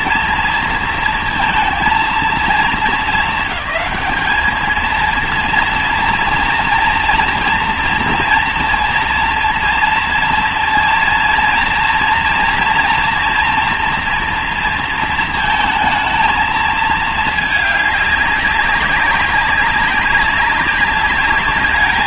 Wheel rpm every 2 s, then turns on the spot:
230, 220, 220, 230, 230, 230, 240, 230, 220, 200, 190.
none